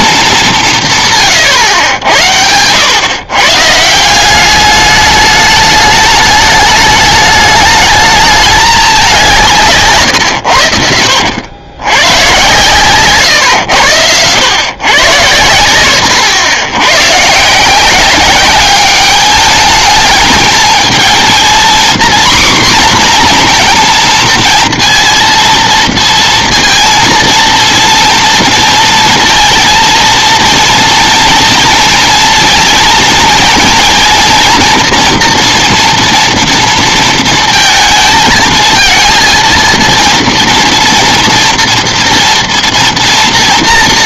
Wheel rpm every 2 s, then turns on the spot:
190, 100, 200, 210, 210, 90, 130, 110, 100, 200, 220, 250, 230, 230, 230, 230, 230, 240, 230, 230, 230, 230.
none